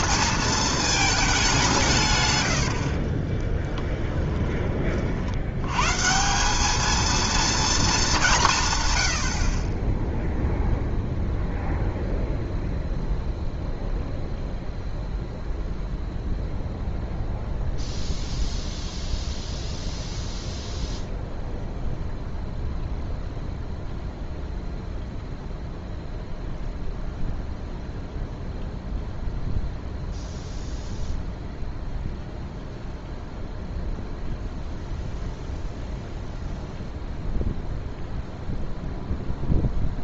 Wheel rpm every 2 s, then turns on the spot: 220, 60, 30, 210, 130, 0, 0, 0, 0, 0, 0, 0, 0, 0, 0, 0, 0, 0, 0, 0.
2-4